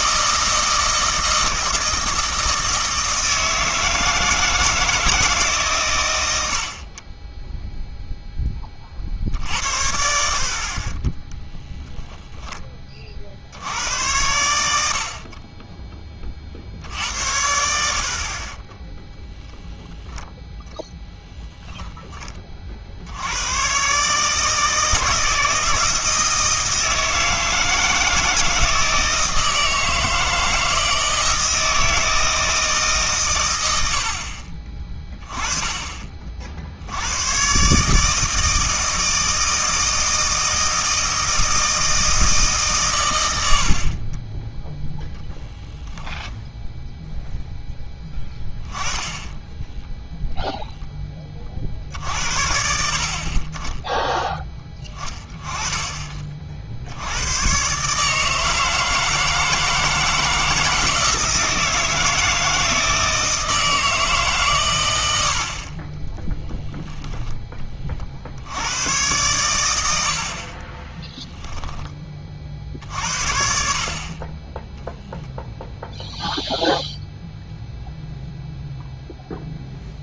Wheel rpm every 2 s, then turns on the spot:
160, 160, 160, 60, 30, 50, 10, 80, 60, 20, 0, 40, 160, 160, 160, 160, 160, 40, 70, 160, 160, 140, 10, 10, 10, 0, 60, 10, 60, 160, 160, 160, 120, 0, 90, 30, 50, 10, 0, 0.
46-48